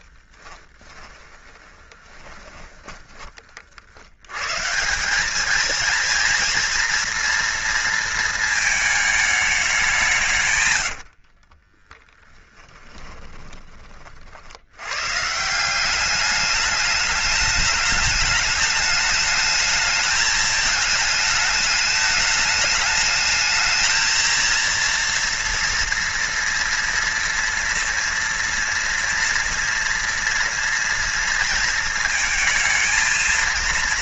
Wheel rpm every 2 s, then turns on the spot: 20, 20, 160, 240, 220, 120, 20, 100, 200, 210, 220, 210, 230, 230, 230, 230, 220.
0-4 10-14